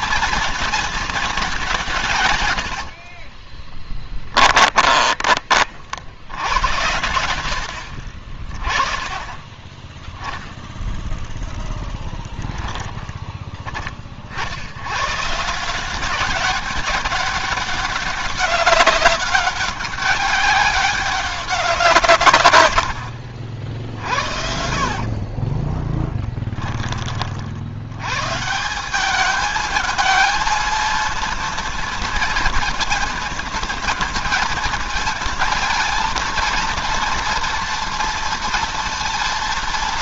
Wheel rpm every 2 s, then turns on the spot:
220, 60, 30, 90, 30, 0, 10, 110, 190, 200, 200, 90, 40, 30, 190, 230, 230, 230, 230, 230.
2-6 24-26